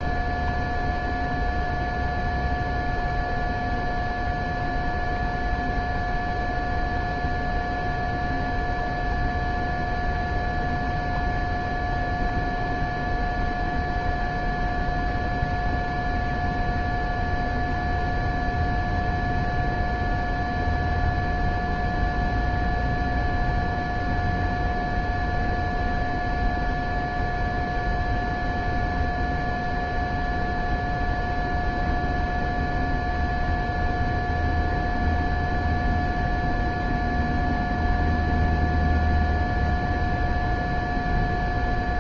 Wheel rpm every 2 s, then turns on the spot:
0, 0, 0, 0, 0, 0, 0, 0, 0, 0, 0, 0, 0, 0, 0, 0, 0, 0, 0, 0, 0.
none